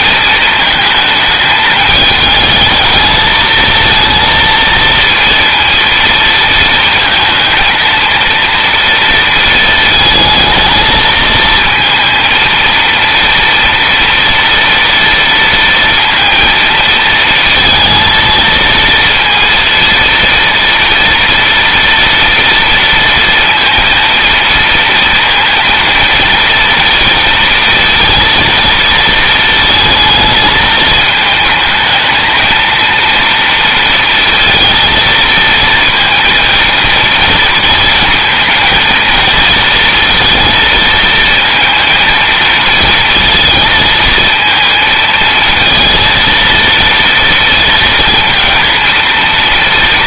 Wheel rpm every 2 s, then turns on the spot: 220, 220, 230, 230, 230, 220, 230, 230, 230, 230, 230, 230, 230, 230, 230, 220, 230, 230, 230, 230, 230, 230, 220, 230, 230.
none